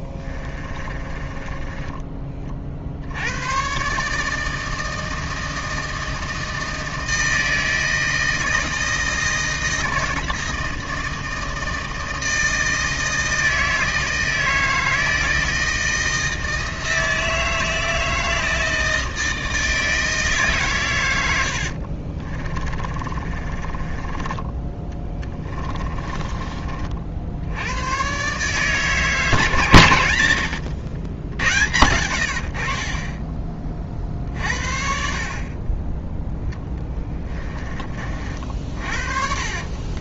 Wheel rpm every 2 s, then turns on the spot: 20, 60, 160, 160, 160, 160, 160, 160, 160, 160, 120, 30, 10, 40, 150, 130, 30, 50, 10, 40.
0-2 22-26 36-40